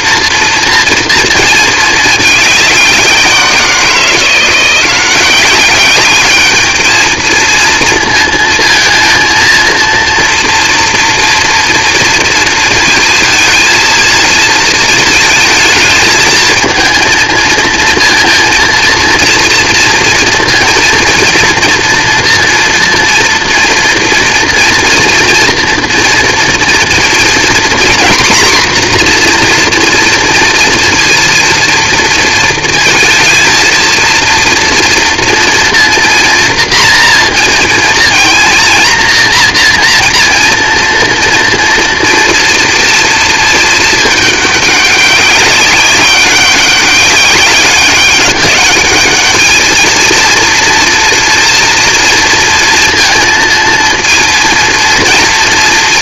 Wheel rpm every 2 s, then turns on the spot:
230, 180, 190, 230, 230, 240, 230, 220, 230, 230, 230, 230, 230, 230, 240, 230, 220, 230, 230, 240, 230, 220, 200, 200, 220, 230, 230, 230.
none